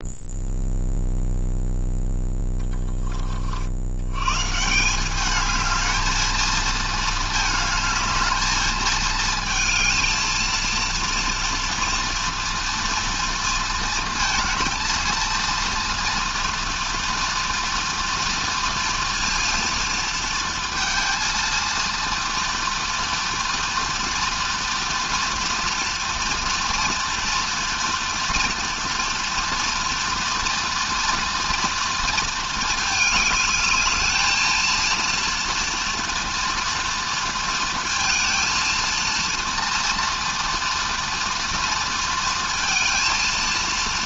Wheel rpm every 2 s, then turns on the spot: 0, 20, 150, 220, 220, 230, 230, 230, 230, 230, 230, 230, 230, 240, 240, 240, 220, 230, 230, 230, 230, 230.
none